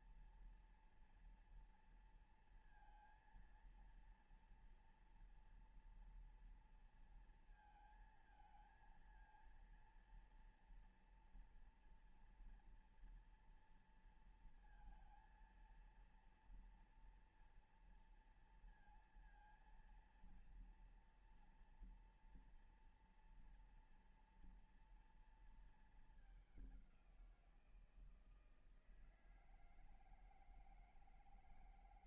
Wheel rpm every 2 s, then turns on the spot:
240, 230, 230, 230, 230, 230, 230, 230, 230, 230, 230, 230, 230, 210, 160, 160.
none